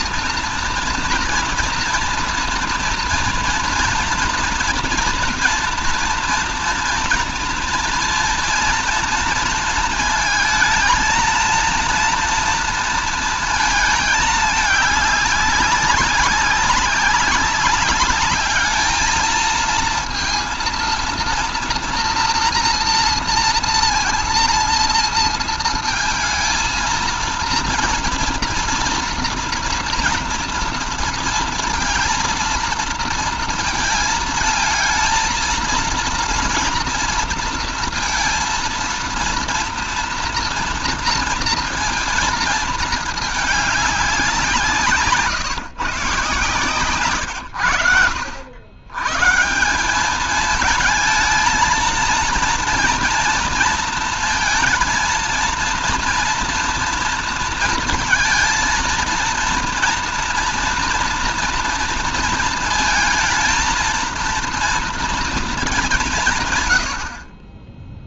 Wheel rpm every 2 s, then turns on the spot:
230, 230, 240, 230, 230, 220, 230, 210, 200, 210, 230, 240, 230, 230, 230, 230, 230, 220, 230, 230, 230, 220, 170, 140, 90, 220, 230, 230, 230, 230, 240, 230, 230, 140.
none